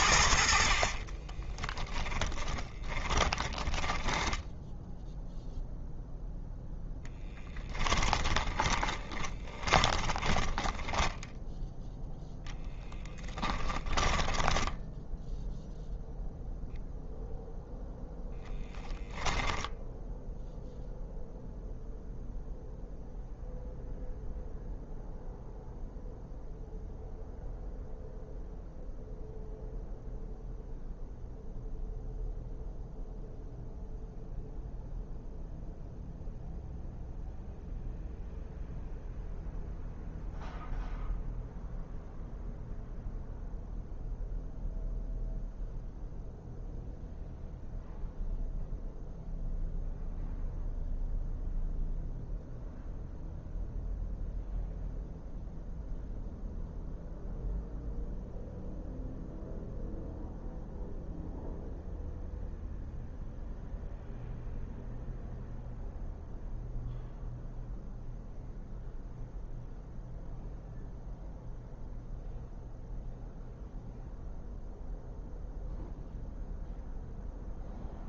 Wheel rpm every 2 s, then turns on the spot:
50, 30, 10, 0, 20, 10, 10, 10, 0, 10, 0, 0, 0, 0, 0, 0, 0, 0, 0, 0, 0, 0, 0, 0, 0, 0, 0, 0, 0, 0, 0, 0, 0, 0, 0, 0, 0, 0, 0.
0-6 8-16 18-20